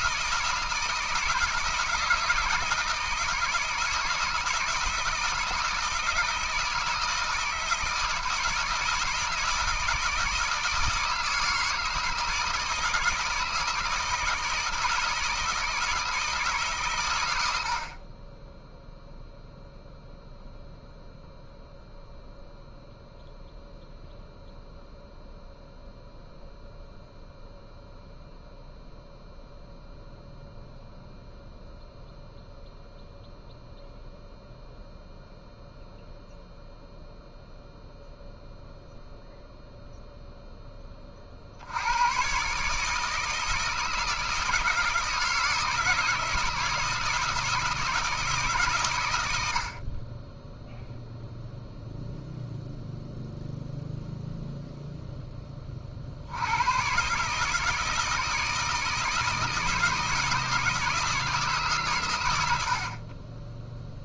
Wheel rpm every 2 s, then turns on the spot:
160, 160, 170, 160, 160, 160, 160, 160, 130, 0, 0, 0, 0, 0, 0, 0, 0, 0, 0, 0, 20, 160, 160, 160, 120, 0, 0, 0, 130, 160, 160, 50.
none